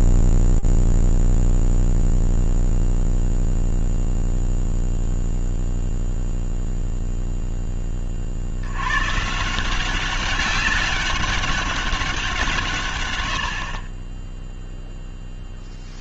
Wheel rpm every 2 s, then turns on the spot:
0, 0, 0, 10, 170, 200, 50, 0.
none